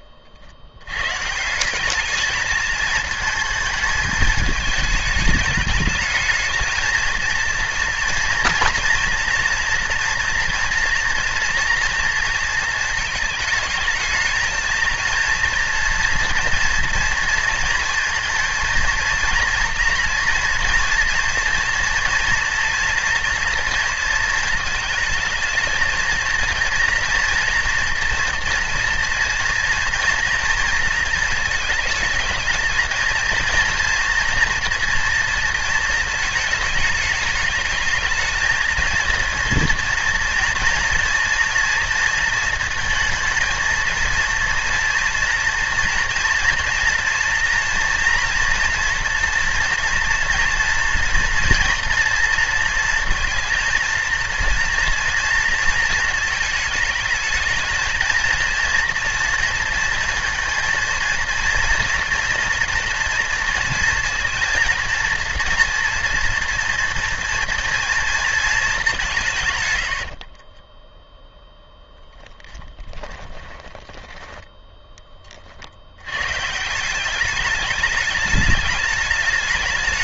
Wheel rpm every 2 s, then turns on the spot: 100, 220, 220, 220, 230, 230, 220, 230, 240, 230, 240, 230, 220, 230, 230, 230, 230, 230, 210, 220, 230, 230, 230, 240, 230, 230, 230, 230, 220, 230, 230, 230, 230, 230, 200, 20, 10, 10, 170, 210.
70-74